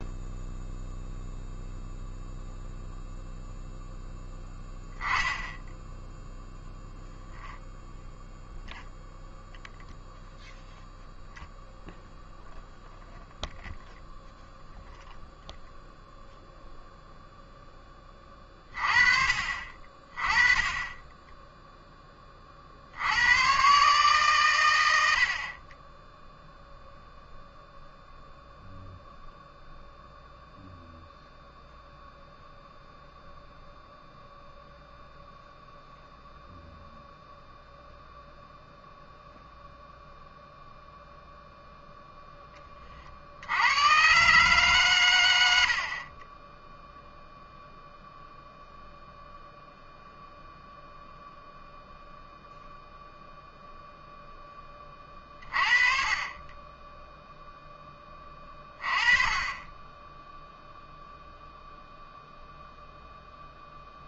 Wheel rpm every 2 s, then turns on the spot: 0, 0, 10, 0, 0, 0, 0, 0, 0, 30, 20, 50, 110, 0, 0, 0, 0, 0, 0, 0, 0, 30, 130, 0, 0, 0, 0, 20, 10, 20, 0, 0.
none